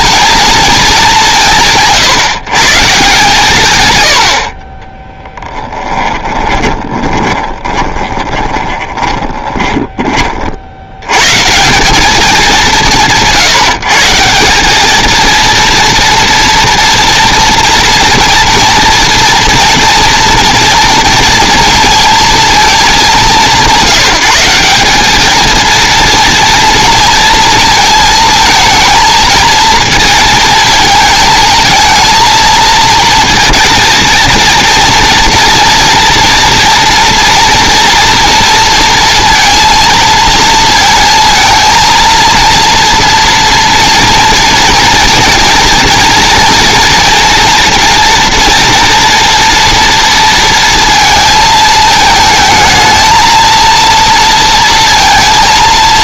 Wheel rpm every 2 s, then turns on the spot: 220, 150, 20, 20, 20, 70, 180, 210, 230, 230, 230, 210, 190, 230, 220, 220, 230, 240, 230, 230, 230, 230, 230, 230, 230, 230, 220, 230.
6-10